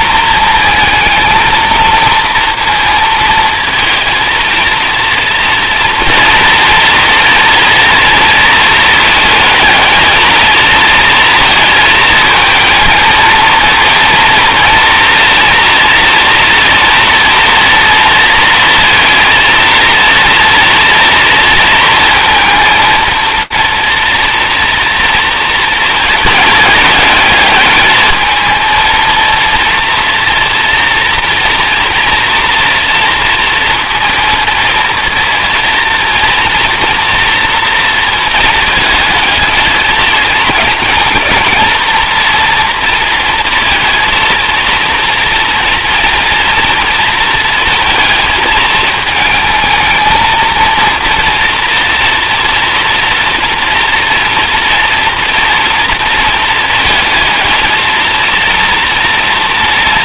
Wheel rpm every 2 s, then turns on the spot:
220, 230, 220, 230, 230, 220, 220, 240, 230, 230, 230, 230, 230, 220, 220, 230, 230, 230, 230, 220, 220, 230, 230, 230, 220, 230, 230, 230, 230, 230.
none